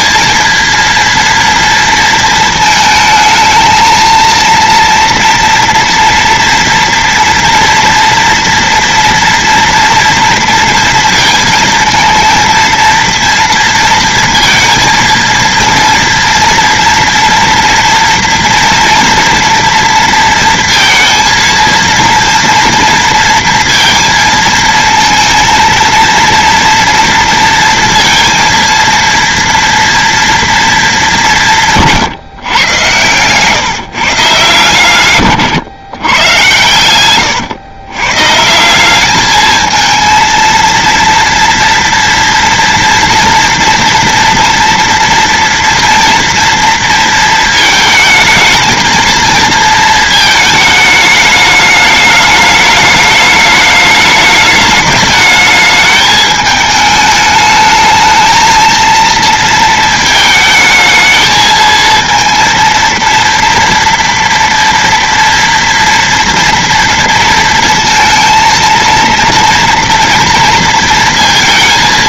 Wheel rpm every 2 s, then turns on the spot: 230, 220, 230, 230, 230, 230, 230, 230, 230, 230, 230, 230, 220, 230, 230, 230, 130, 140, 110, 170, 230, 230, 230, 230, 220, 220, 210, 210, 220, 220, 220, 230, 240, 230, 230, 230.
none